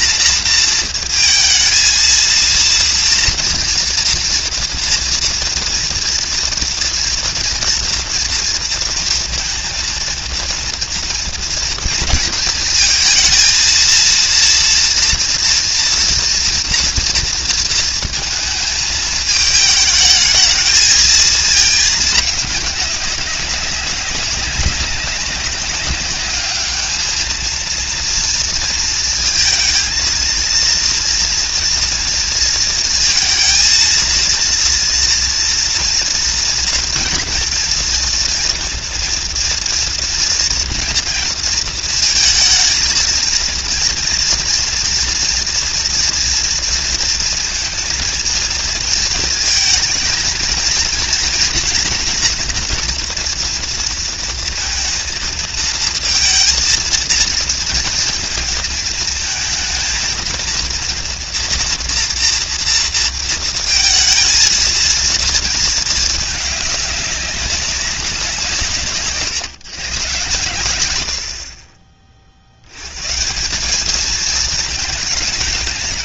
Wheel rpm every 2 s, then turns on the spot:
230, 230, 230, 230, 230, 230, 230, 230, 230, 230, 220, 220, 200, 200, 230, 230, 230, 230, 230, 240, 230, 230, 230, 230, 230, 230, 230, 230, 230, 230, 230, 240, 220, 220, 200, 130, 40, 200.
none